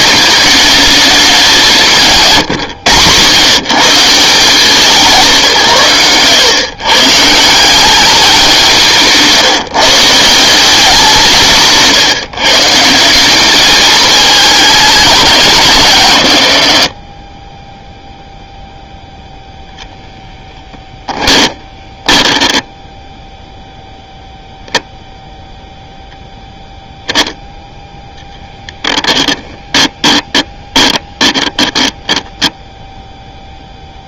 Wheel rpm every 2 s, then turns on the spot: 210, 150, 180, 120, 190, 180, 150, 210, 70, 0, 10, 10, 0, 10, 10, 20, 0.
20-22 28-30